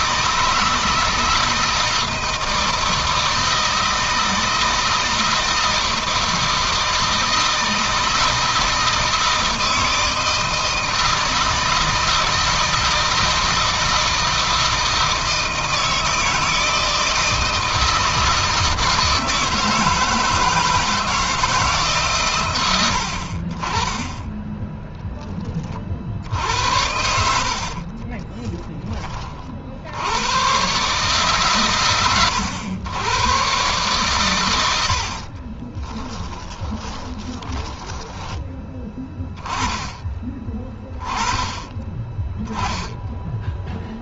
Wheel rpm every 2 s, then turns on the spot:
160, 160, 160, 160, 160, 160, 160, 160, 160, 160, 160, 100, 10, 80, 30, 140, 130, 70, 20, 20, 30, 10.
26-28 34-38